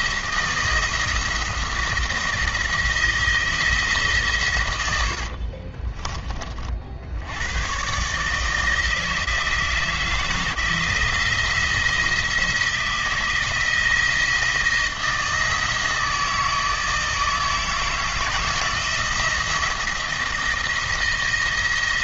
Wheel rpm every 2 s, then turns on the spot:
160, 160, 80, 60, 160, 170, 160, 160, 160, 160, 170.
4-6